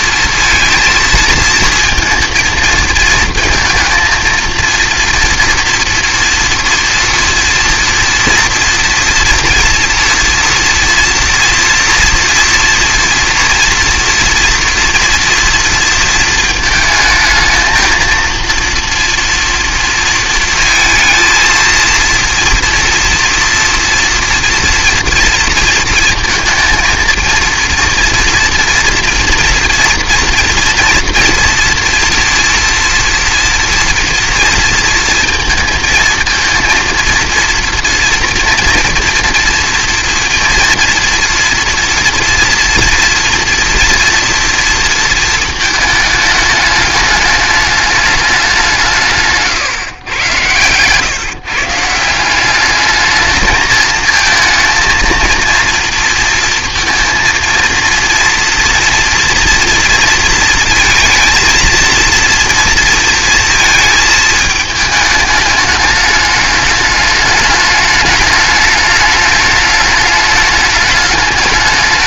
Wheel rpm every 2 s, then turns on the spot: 230, 230, 230, 230, 230, 240, 240, 240, 220, 230, 220, 230, 230, 230, 240, 230, 240, 230, 230, 230, 230, 230, 230, 210, 180, 110, 200, 230, 230, 230, 230, 230, 220, 210, 210, 210.
50-52